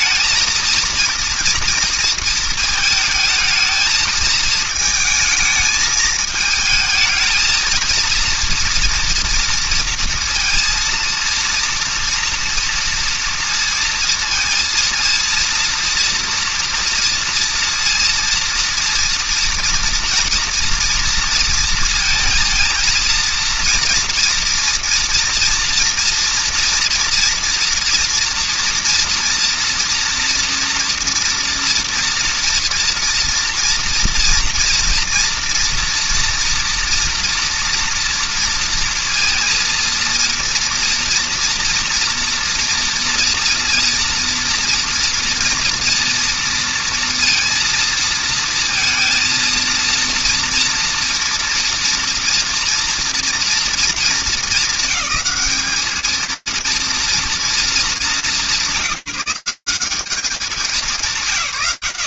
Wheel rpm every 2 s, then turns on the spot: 220, 230, 220, 220, 230, 230, 230, 230, 230, 230, 230, 230, 230, 230, 230, 240, 240, 230, 230, 230, 230, 230, 230, 230, 230, 230, 230, 230, 220, 240, 180.
none